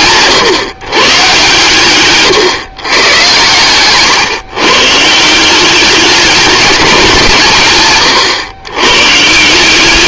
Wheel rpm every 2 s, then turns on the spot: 120, 120, 150, 190, 130.
none